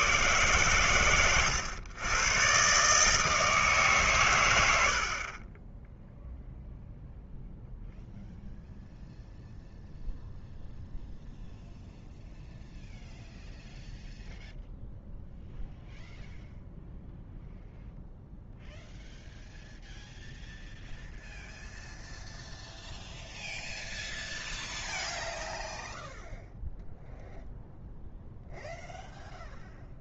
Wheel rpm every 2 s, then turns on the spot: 110, 130, 80, 0, 0, 0, 0, 0, 0, 0, 0, 0, 0, 0, 0.
none